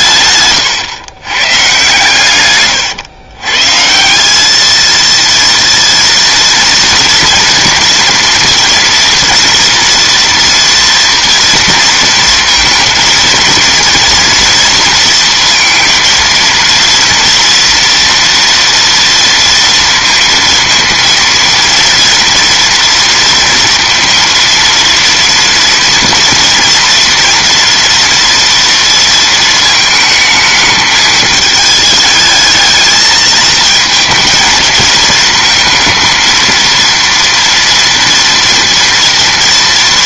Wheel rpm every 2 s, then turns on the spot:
130, 120, 210, 230, 230, 230, 230, 230, 230, 230, 230, 230, 230, 230, 230, 220, 220, 220, 230, 230.
0-4